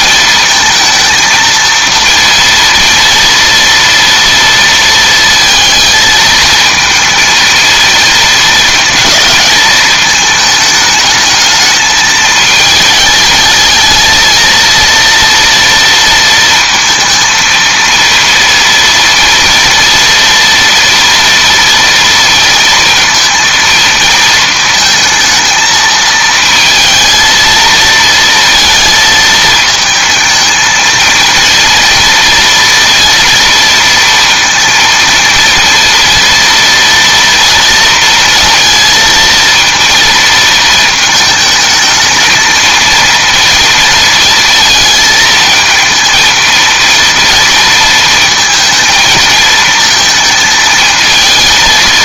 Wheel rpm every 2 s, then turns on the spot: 230, 230, 230, 220, 220, 220, 220, 230, 230, 230, 230, 230, 220, 230, 230, 230, 230, 230, 230, 230, 220, 230, 220, 230, 220, 220.
none